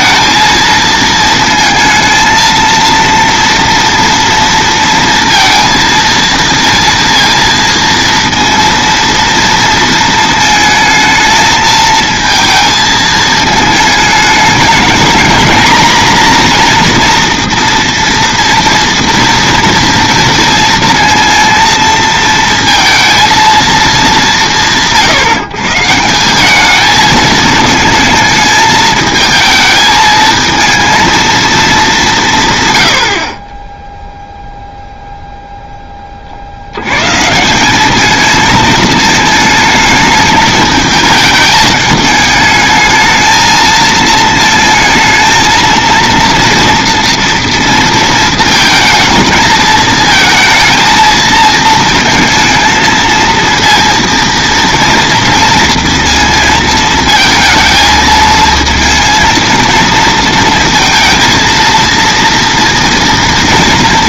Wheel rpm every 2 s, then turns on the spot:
230, 230, 230, 230, 230, 220, 220, 210, 240, 230, 230, 230, 170, 210, 220, 230, 120, 0, 80, 220, 220, 220, 220, 230, 220, 220, 220, 230, 220, 220, 220, 230.
none